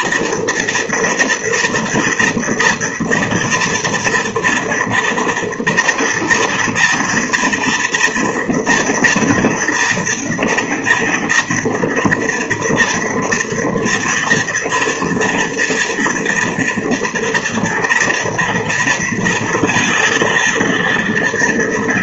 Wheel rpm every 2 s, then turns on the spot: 230, 230, 240, 230, 230, 240, 230, 230, 230, 240, 230.
none